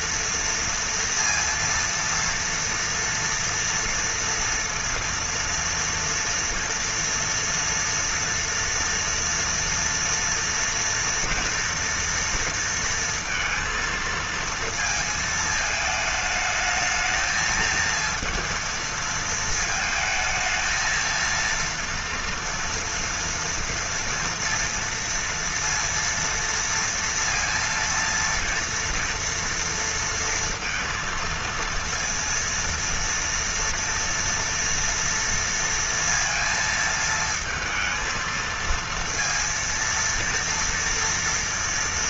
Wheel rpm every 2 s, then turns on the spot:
230, 230, 230, 230, 230, 230, 230, 230, 210, 230, 230, 230, 230, 230, 230, 230, 230, 230, 230, 230, 230.
none